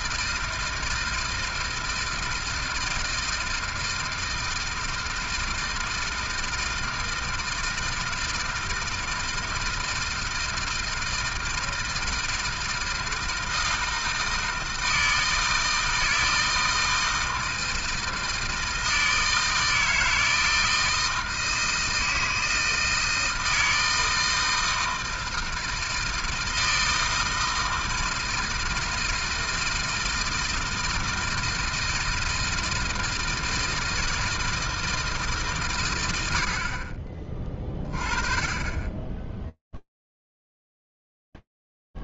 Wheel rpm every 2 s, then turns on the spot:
160, 160, 160, 160, 160, 160, 160, 160, 160, 160, 160, 160, 160, 160, 160, 160, 160, 160, 80, 20, 0.
none